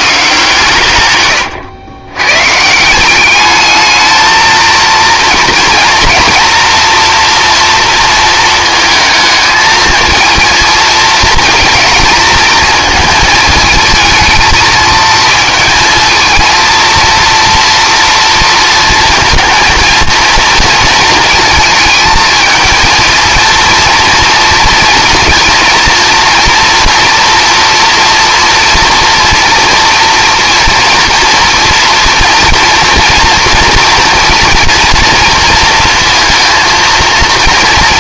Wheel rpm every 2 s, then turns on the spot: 150, 150, 230, 230, 220, 220, 220, 220, 230, 230, 230, 220, 230, 240, 230, 230, 230, 230, 230.
none